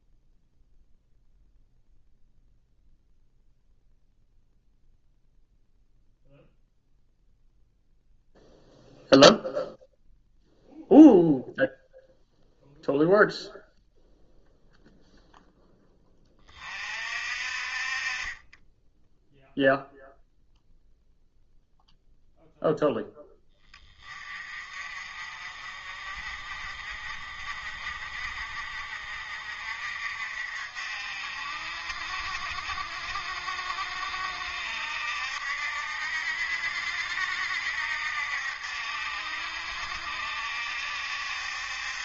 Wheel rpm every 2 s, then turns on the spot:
0, 0, 0, 0, 0, 0, 0, 0, 40, 10, 0, 0, 40, 40, 50, 60, 70, 70, 70, 70, 70.
none